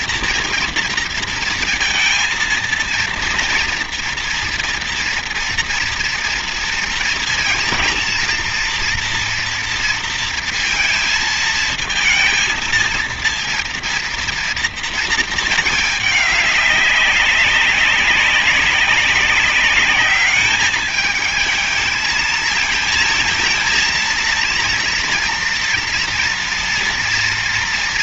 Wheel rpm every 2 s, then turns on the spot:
230, 230, 230, 230, 230, 230, 230, 230, 200, 190, 210, 220, 230, 230.
none